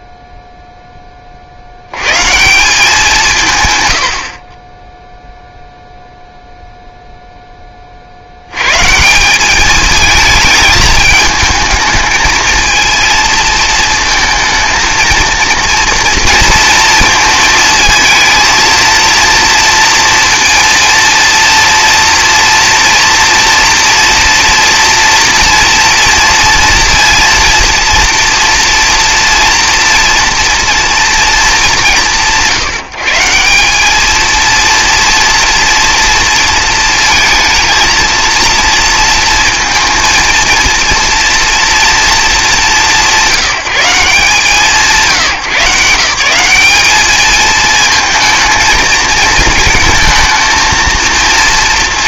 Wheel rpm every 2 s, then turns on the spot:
0, 190, 20, 0, 140, 210, 230, 230, 230, 230, 230, 240, 230, 230, 230, 230, 150, 230, 230, 230, 230, 200, 170, 200, 220, 220.
none